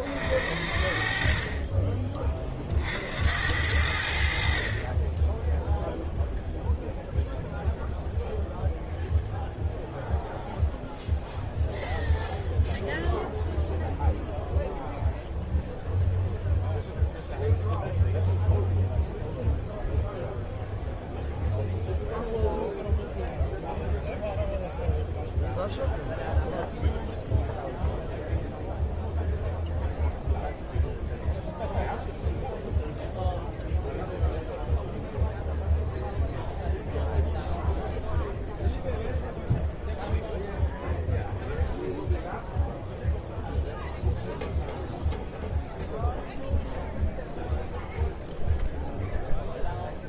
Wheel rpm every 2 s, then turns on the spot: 50, 40, 50, 0, 0, 0, 0, 0, 0, 0, 0, 0, 0, 0, 0, 0, 0, 0, 0, 0, 0, 0, 0, 0, 0.
none